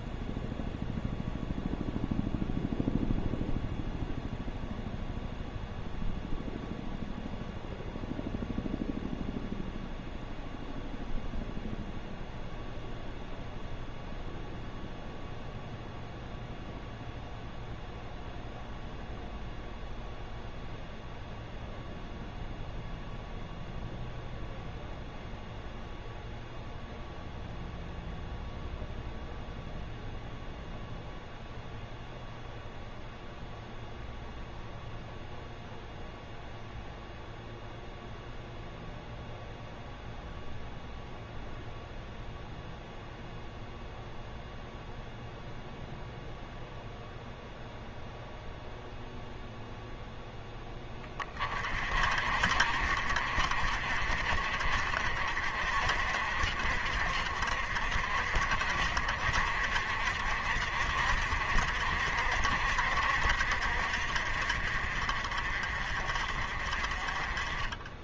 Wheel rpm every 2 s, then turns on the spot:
0, 0, 0, 0, 0, 0, 0, 0, 0, 0, 0, 0, 0, 0, 0, 0, 0, 0, 0, 0, 0, 0, 0, 0, 0, 10, 60, 50, 60, 60, 60, 60, 50, 40.
none